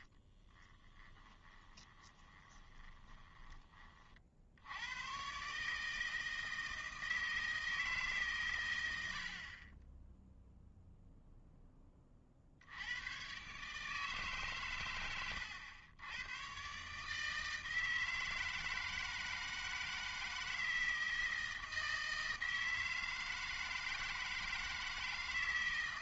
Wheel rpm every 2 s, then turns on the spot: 10, 20, 90, 160, 110, 0, 70, 120, 130, 160, 160, 160, 160.
0-4